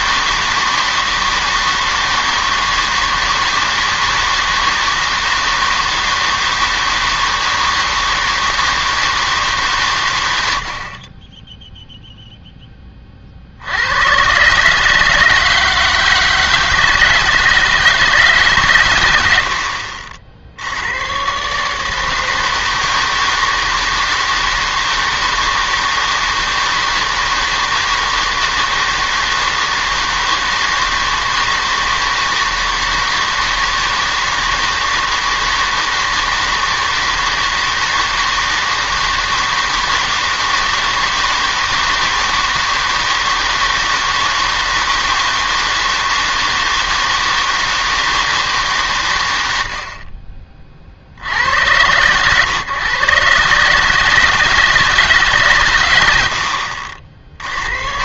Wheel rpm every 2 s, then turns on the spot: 160, 160, 160, 160, 160, 60, 10, 140, 160, 130, 80, 160, 160, 160, 160, 160, 160, 160, 160, 160, 160, 160, 160, 160, 130, 30, 110, 160, 60.
none